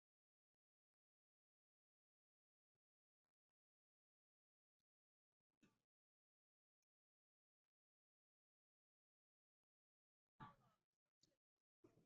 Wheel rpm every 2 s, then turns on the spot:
0, 0, 0, 0, 0, 0.
none